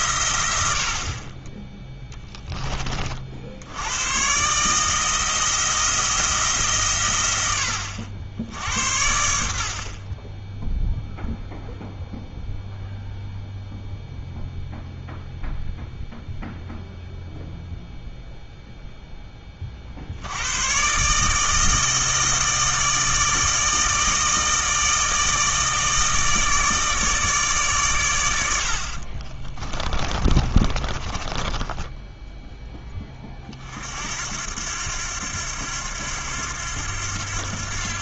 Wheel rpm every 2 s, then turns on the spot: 90, 10, 140, 150, 70, 10, 0, 0, 0, 0, 110, 160, 160, 160, 80, 30, 10, 80, 90.
30-32